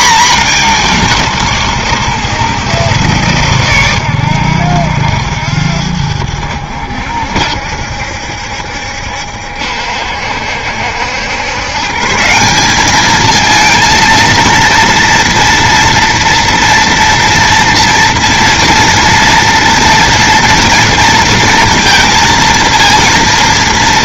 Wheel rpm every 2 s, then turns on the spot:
220, 140, 90, 80, 70, 70, 190, 230, 230, 230, 230, 230.
none